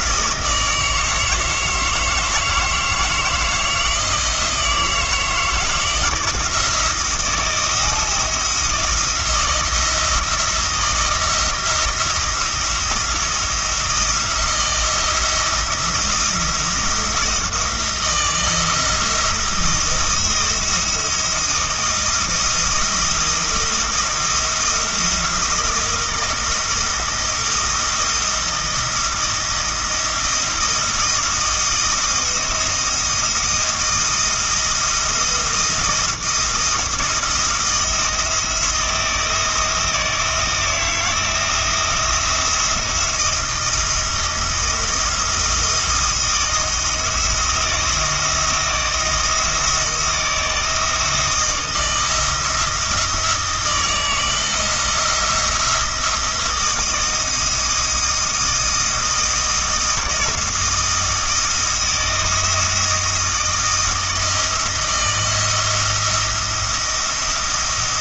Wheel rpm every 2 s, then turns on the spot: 160, 160, 170, 160, 170, 170, 170, 170, 170, 160, 170, 170, 170, 170, 160, 170, 170, 170, 170, 160, 160, 170, 170, 170, 170, 160, 170, 160, 160, 160, 170, 160, 170, 170.
none